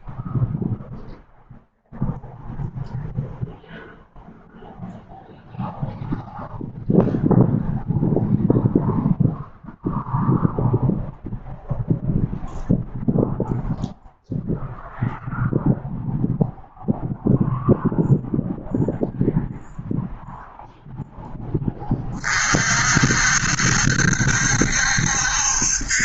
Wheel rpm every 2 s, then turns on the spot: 0, 0, 0, 0, 0, 0, 0, 0, 0, 0, 0, 50, 70.
none